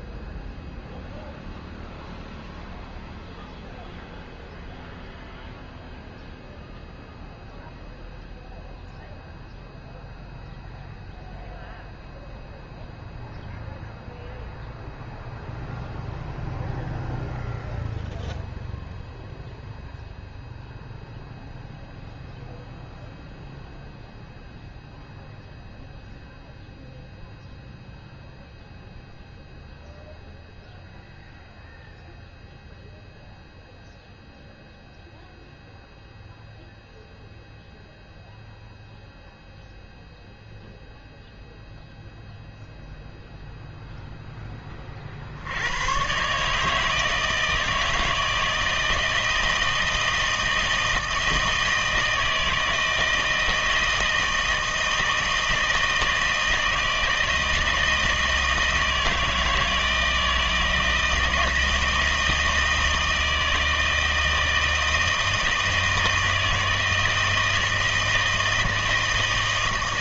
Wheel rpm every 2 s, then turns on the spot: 0, 0, 0, 0, 0, 0, 0, 0, 0, 0, 0, 0, 0, 0, 0, 0, 0, 0, 0, 0, 0, 0, 20, 150, 160, 160, 160, 160, 160, 160, 160, 160, 160, 160, 160.
none